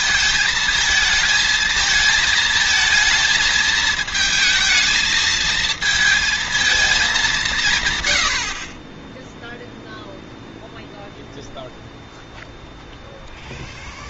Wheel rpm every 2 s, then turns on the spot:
220, 230, 220, 210, 30, 0, 0.
none